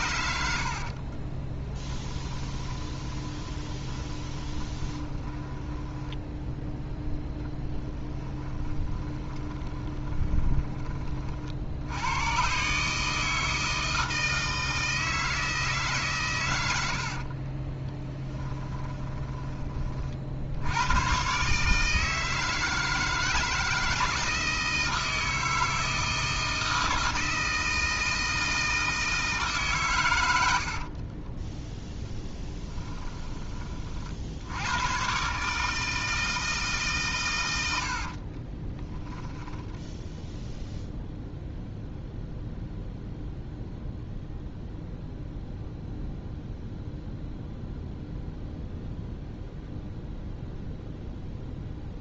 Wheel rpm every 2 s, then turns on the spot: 60, 20, 20, 0, 20, 20, 140, 160, 100, 10, 90, 160, 160, 160, 160, 60, 10, 110, 140, 10, 0, 0, 0, 0, 0, 0.
0-6 8-10 18-20 30-34 38-40